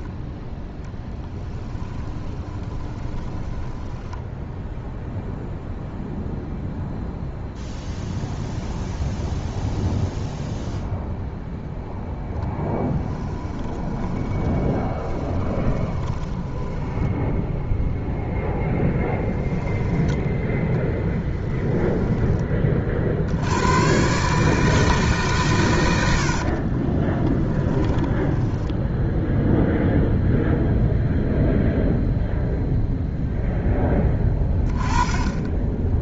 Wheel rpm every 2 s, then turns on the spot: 10, 20, 0, 0, 0, 0, 10, 20, 10, 0, 20, 40, 160, 40, 10, 0, 0, 20.
0-4 12-18 20-22 26-30